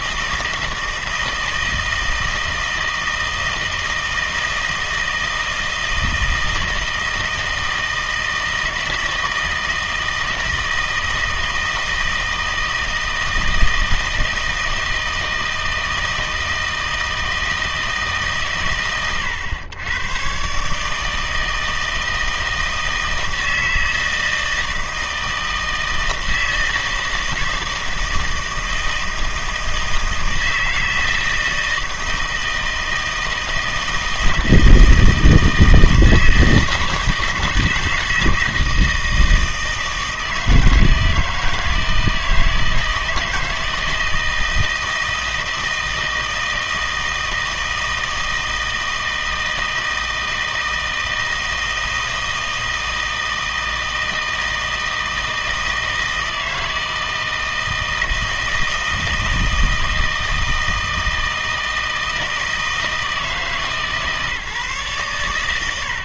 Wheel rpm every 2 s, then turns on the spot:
160, 160, 160, 160, 160, 160, 160, 160, 160, 130, 140, 160, 160, 160, 160, 160, 160, 160, 160, 160, 160, 160, 160, 160, 160, 160, 160, 160, 160, 160, 160, 160, 150.
none